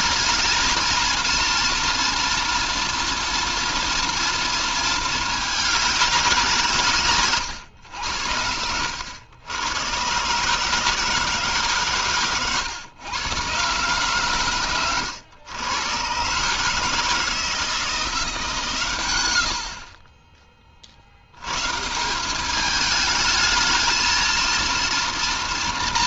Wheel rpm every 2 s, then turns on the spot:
230, 230, 220, 150, 80, 150, 120, 120, 150, 110, 60, 210, 230.
none